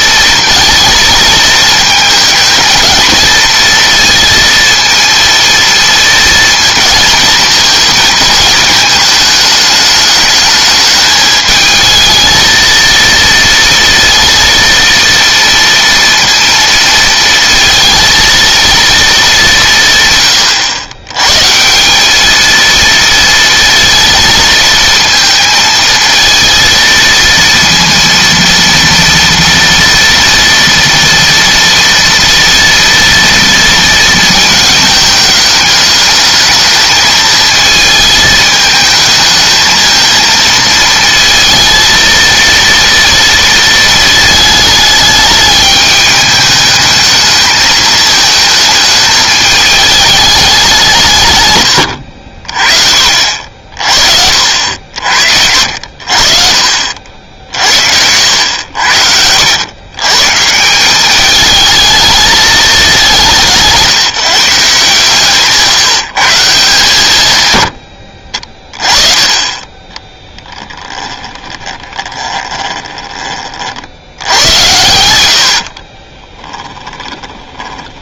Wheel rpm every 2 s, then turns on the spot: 220, 230, 230, 230, 220, 210, 230, 230, 230, 220, 100, 230, 220, 230, 230, 230, 230, 220, 220, 220, 220, 230, 210, 210, 220, 180, 50, 70, 60, 80, 180, 200, 150, 130, 20, 20, 20, 90, 10.
70-74 76-78